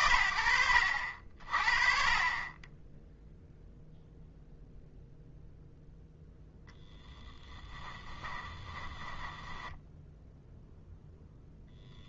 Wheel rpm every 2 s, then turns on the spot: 40, 0, 0, 10, 10, 10.
6-10